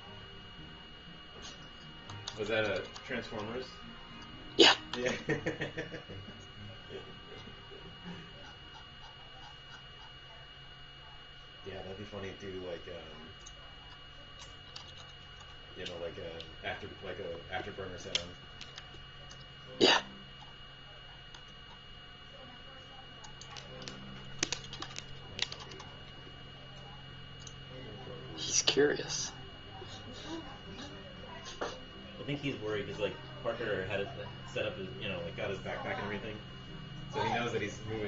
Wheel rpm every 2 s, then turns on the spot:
0, 0, 0, 0, 0, 0, 0, 0, 0, 0, 0, 0, 0, 0, 0, 0, 0, 0, 0.
none